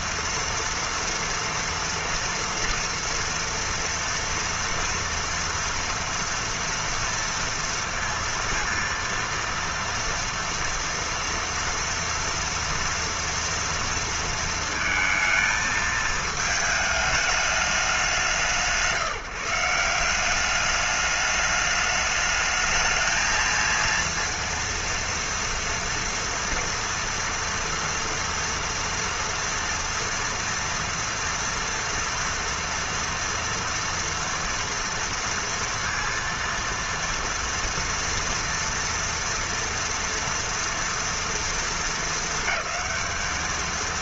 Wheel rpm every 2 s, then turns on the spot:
230, 230, 230, 230, 230, 230, 230, 230, 220, 180, 200, 210, 230, 230, 230, 230, 230, 230, 230, 230, 230, 220.
none